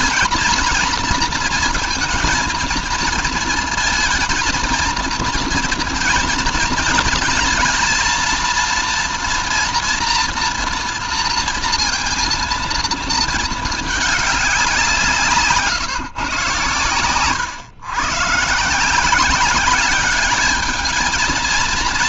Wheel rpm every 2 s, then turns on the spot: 240, 220, 230, 230, 230, 230, 230, 180, 120, 170, 220.
none